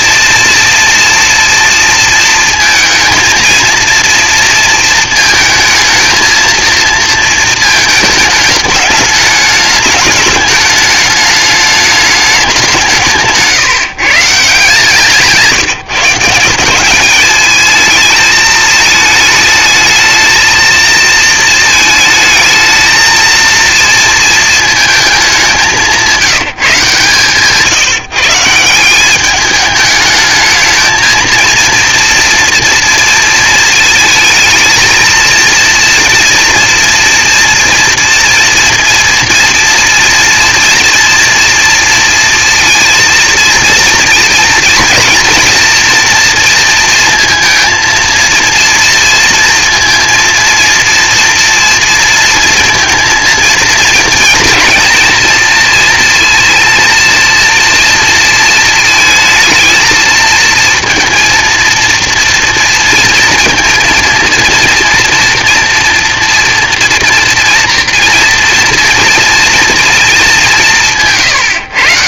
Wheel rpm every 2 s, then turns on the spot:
230, 220, 230, 230, 210, 210, 190, 150, 190, 220, 230, 220, 230, 160, 170, 220, 230, 230, 230, 240, 230, 230, 230, 230, 230, 230, 230, 230, 230, 230, 230, 230, 230, 230, 230, 180.
none